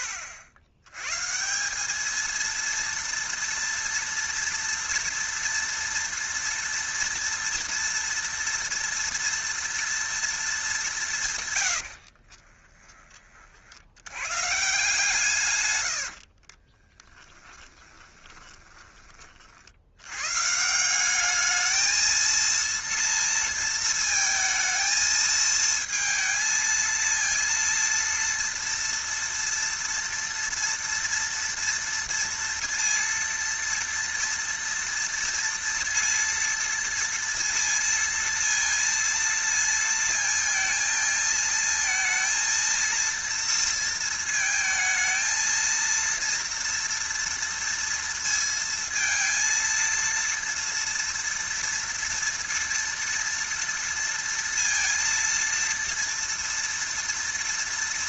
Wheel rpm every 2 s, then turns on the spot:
80, 230, 230, 230, 230, 170, 30, 150, 20, 30, 190, 230, 220, 230, 230, 230, 230, 230, 230, 230, 220, 230, 220, 230, 230, 230, 230, 230, 230.
16-18